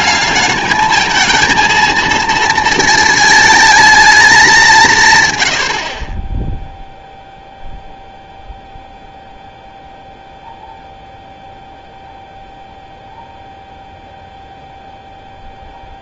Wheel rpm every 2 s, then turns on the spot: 220, 230, 180, 0, 0, 0, 0, 0.
none